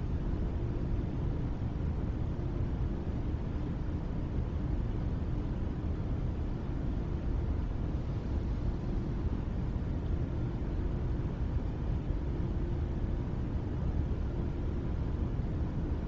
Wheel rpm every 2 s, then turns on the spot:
0, 0, 0, 0, 0, 0, 0, 0.
none